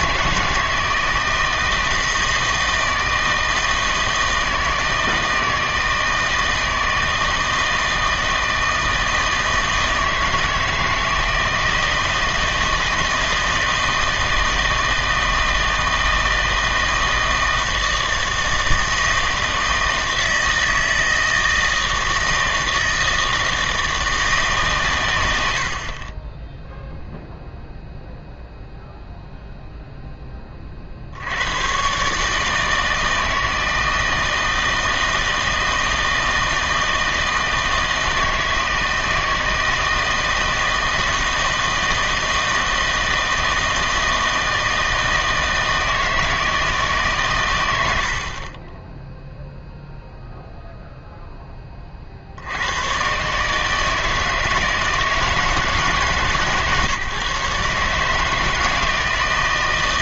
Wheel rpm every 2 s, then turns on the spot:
160, 160, 160, 160, 160, 160, 160, 160, 160, 160, 160, 160, 140, 0, 0, 30, 160, 160, 160, 160, 160, 160, 160, 160, 20, 0, 100, 160, 140, 160.
none